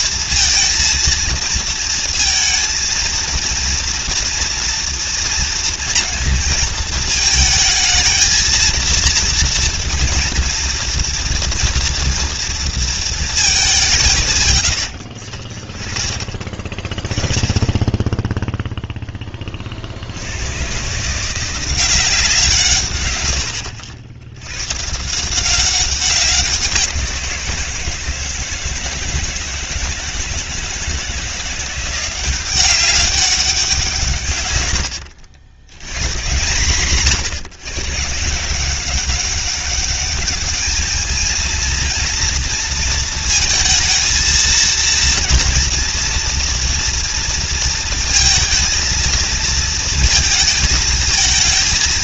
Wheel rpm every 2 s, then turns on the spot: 230, 230, 230, 220, 230, 230, 230, 120, 30, 0, 110, 160, 110, 180, 160, 160, 190, 110, 150, 170, 210, 230, 230, 230, 230, 230.
none